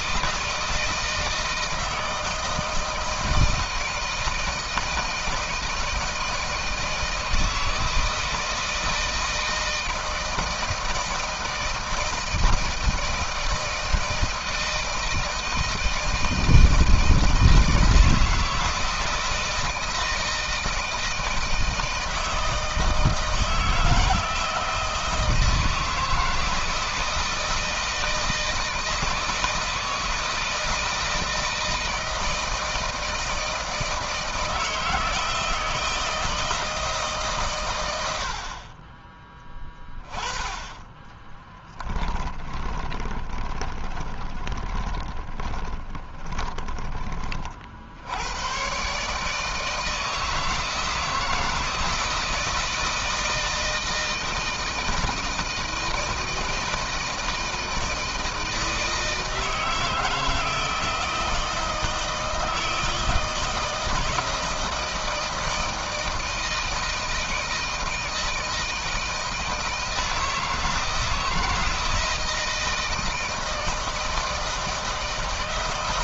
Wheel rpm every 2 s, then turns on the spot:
160, 160, 160, 160, 160, 160, 160, 160, 160, 160, 160, 160, 160, 160, 160, 160, 160, 160, 150, 30, 20, 20, 20, 30, 130, 160, 160, 160, 160, 160, 160, 160, 160, 160, 160, 160, 160, 160.
40-46